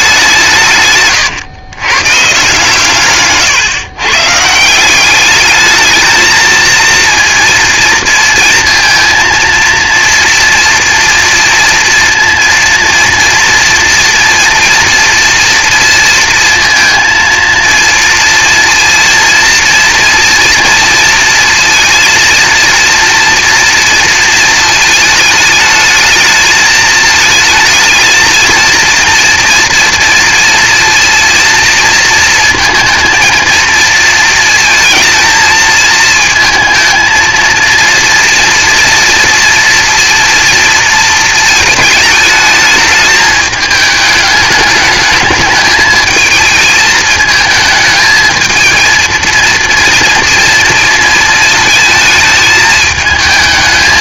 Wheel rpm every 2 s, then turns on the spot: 160, 150, 150, 230, 230, 240, 230, 230, 230, 230, 230, 230, 220, 220, 230, 230, 220, 230, 230, 240, 230, 220, 210, 220, 220, 240, 220.
none